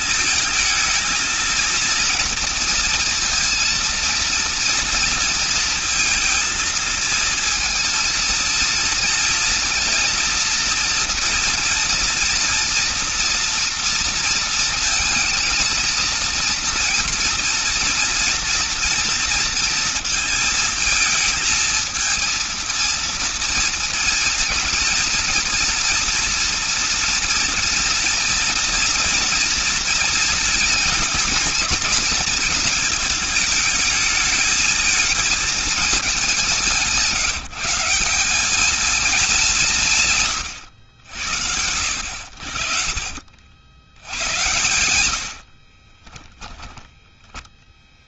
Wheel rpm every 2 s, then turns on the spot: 220, 230, 230, 230, 230, 230, 230, 230, 230, 230, 230, 230, 230, 240, 230, 230, 220, 220, 180, 200, 120, 60, 90, 10.
42-44